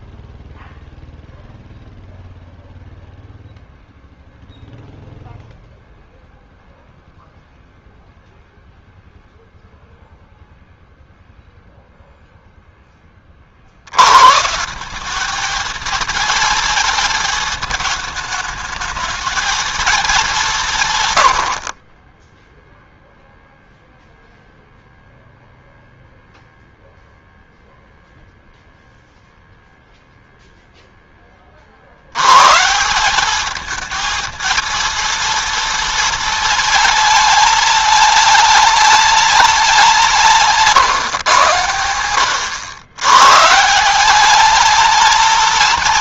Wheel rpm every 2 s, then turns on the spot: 0, 0, 0, 0, 0, 0, 10, 190, 230, 220, 130, 0, 0, 0, 0, 10, 170, 230, 220, 210, 130, 120, 220.
none